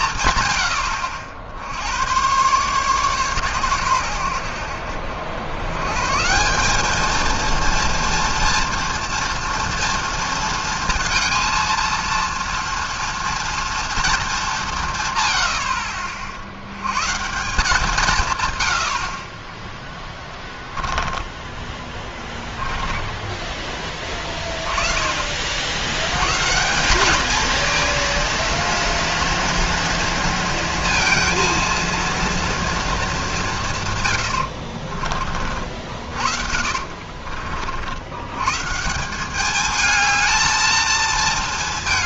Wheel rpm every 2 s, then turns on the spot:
110, 120, 80, 190, 230, 230, 230, 180, 90, 100, 20, 10, 20, 150, 230, 230, 230, 70, 60, 130, 220.
20-24 34-38